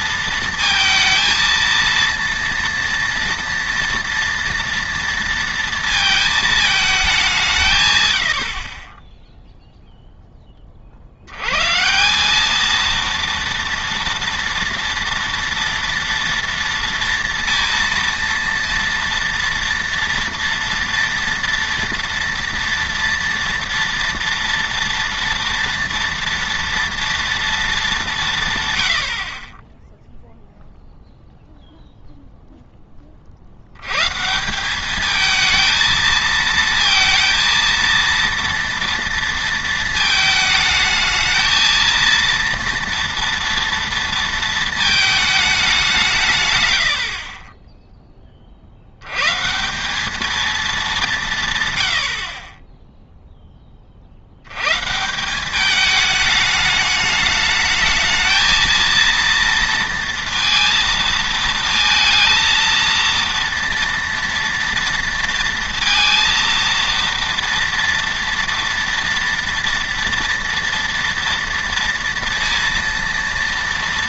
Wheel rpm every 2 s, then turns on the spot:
220, 230, 230, 220, 50, 20, 220, 240, 230, 230, 230, 230, 230, 230, 130, 0, 10, 190, 230, 230, 220, 230, 220, 110, 50, 220, 30, 120, 210, 230, 230, 230, 230, 230, 230, 230, 230.
none